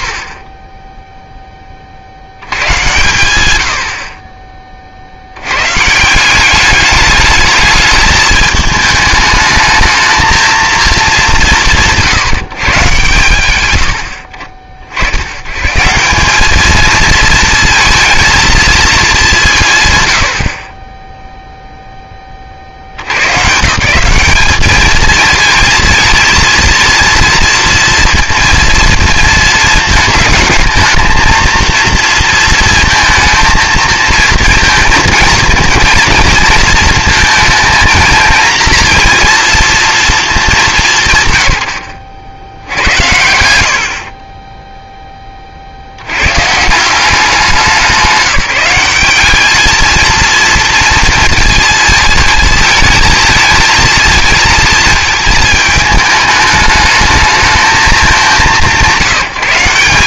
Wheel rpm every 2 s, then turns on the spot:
10, 100, 60, 210, 220, 210, 130, 60, 220, 210, 10, 90, 220, 230, 230, 220, 230, 230, 220, 230, 140, 90, 0, 170, 190, 230, 220, 220, 210, 160.
none